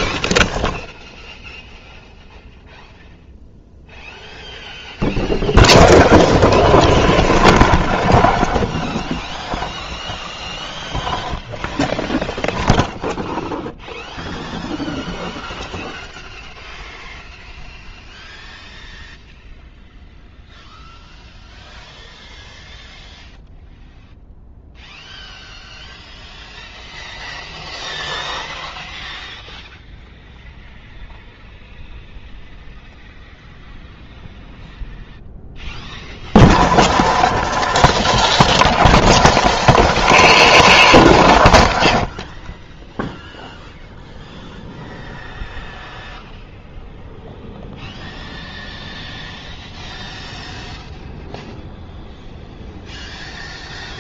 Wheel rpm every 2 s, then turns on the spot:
10, 0, 0, 0, 0, 0, 0, 0, 0, 0, 0, 0, 0, 0, 0, 0, 0, 0, 0, 0, 0, 0, 0, 0, 0, 0, 0.
none